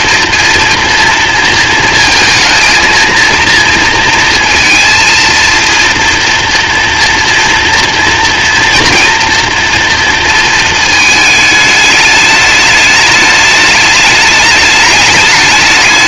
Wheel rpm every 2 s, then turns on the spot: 230, 230, 230, 230, 230, 220, 210, 210.
none